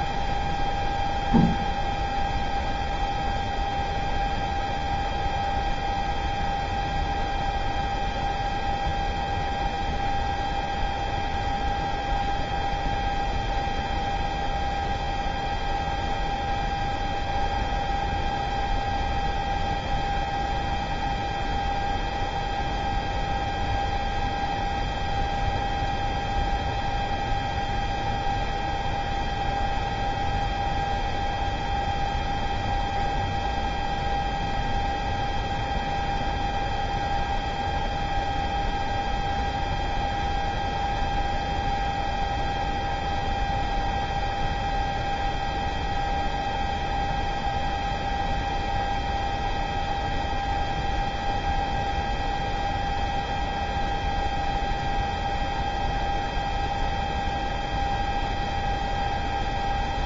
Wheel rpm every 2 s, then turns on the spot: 0, 0, 0, 0, 0, 0, 0, 0, 0, 0, 0, 0, 0, 0, 0, 0, 0, 0, 0, 0, 0, 0, 0, 0, 0, 0, 0, 0, 0, 0.
none